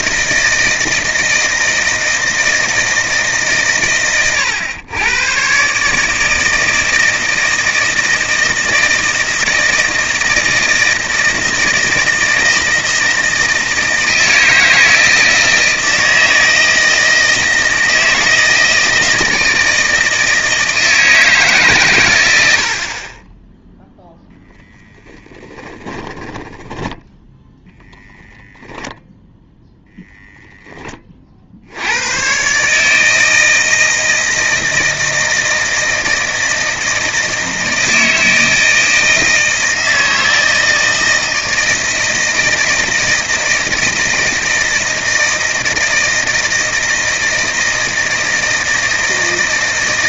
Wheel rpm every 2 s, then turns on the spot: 160, 160, 110, 160, 160, 160, 160, 160, 160, 160, 160, 70, 0, 10, 0, 10, 140, 160, 160, 160, 160, 160, 160, 160, 160.
26-28